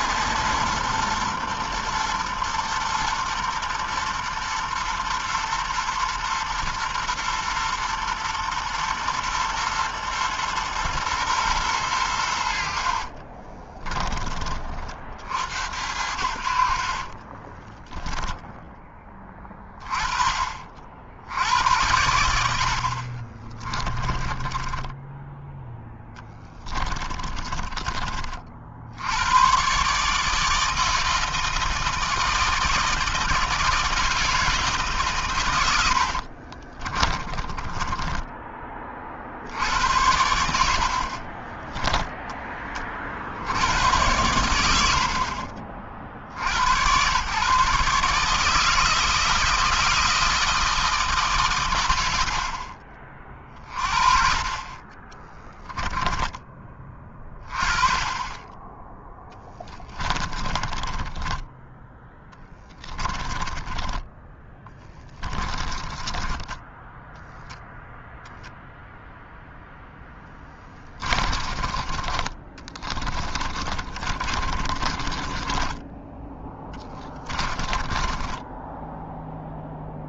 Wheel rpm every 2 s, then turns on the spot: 120, 120, 120, 120, 120, 120, 40, 60, 30, 20, 80, 40, 10, 20, 90, 160, 160, 140, 20, 50, 40, 60, 50, 110, 160, 150, 30, 20, 30, 10, 20, 20, 30, 10, 0, 30, 30, 30, 20, 10.
12-14 16-18 22-28 36-38 54-56 60-68 70-78